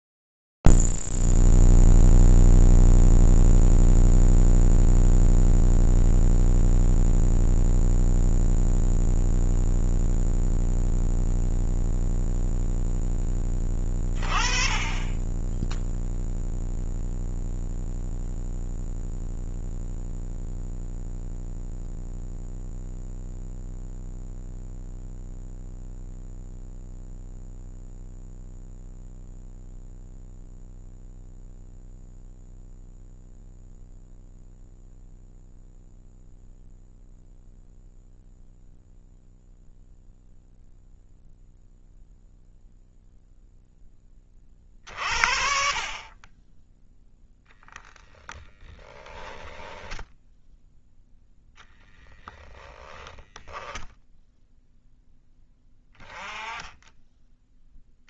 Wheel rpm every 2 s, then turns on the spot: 0, 0, 0, 0, 0, 0, 0, 20, 0, 0, 0, 0, 0, 0, 0, 0, 0, 0, 0, 0, 0, 0, 50, 10, 20, 0, 10, 10, 10.
48-50 52-54